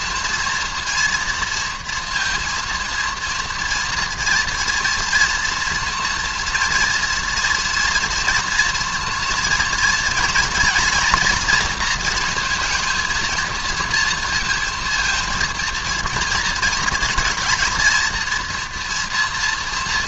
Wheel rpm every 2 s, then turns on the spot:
230, 230, 230, 230, 230, 230, 230, 230, 220, 230.
none